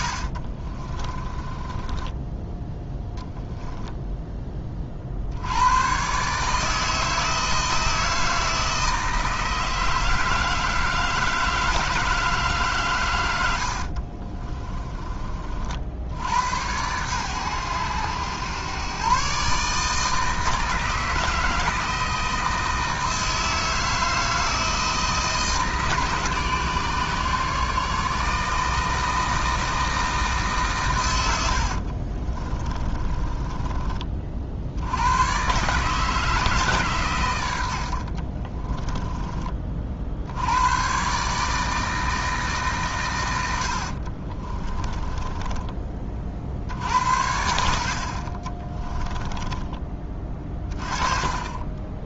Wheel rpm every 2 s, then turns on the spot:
20, 0, 40, 160, 160, 160, 140, 30, 100, 120, 160, 160, 160, 150, 160, 120, 30, 90, 140, 20, 120, 130, 20, 70, 20, 30.
0-2 14-16 32-34 38-40 44-46 48-50